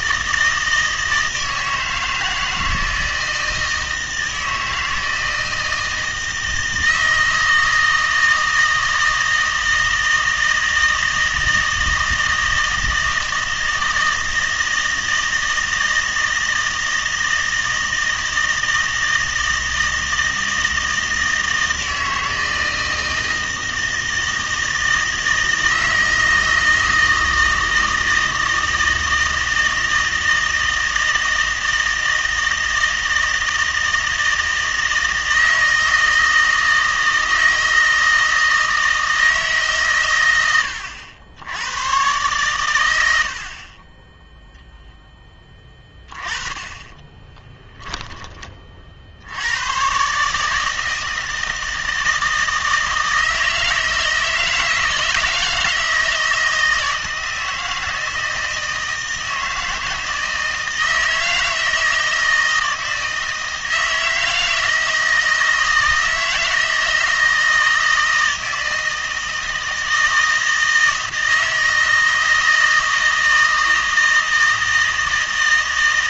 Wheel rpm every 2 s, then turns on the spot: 160, 160, 160, 160, 160, 160, 160, 160, 160, 160, 160, 160, 160, 160, 160, 160, 160, 160, 160, 160, 100, 130, 0, 20, 20, 150, 160, 160, 160, 160, 160, 160, 160, 160, 160, 160, 160, 160.
none